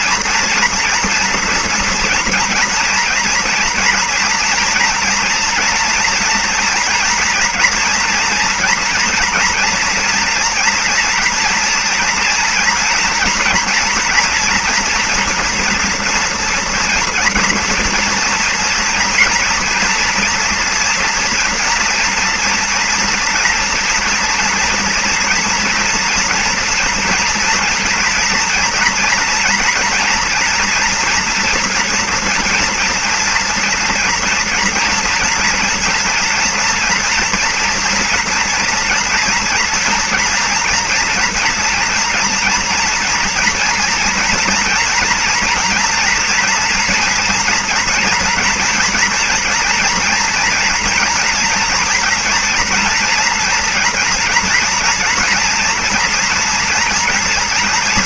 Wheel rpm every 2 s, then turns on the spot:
240, 230, 230, 230, 230, 230, 230, 230, 230, 230, 240, 240, 240, 240, 230, 230, 230, 230, 230, 240, 240, 230, 230, 230, 230, 240, 230, 240, 230.
none